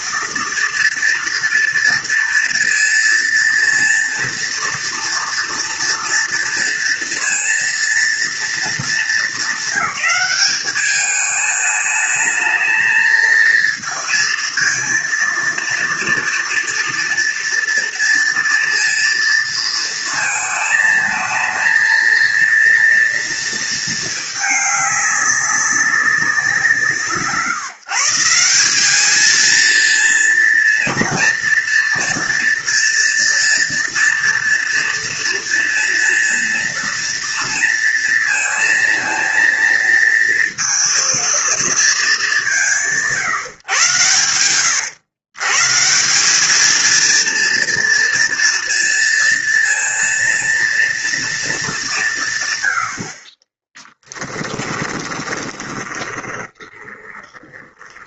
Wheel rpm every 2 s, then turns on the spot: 230, 230, 230, 230, 220, 210, 220, 230, 230, 230, 220, 230, 200, 170, 200, 240, 230, 230, 230, 230, 230, 150, 130, 220, 230, 230, 90, 10, 20.
54-58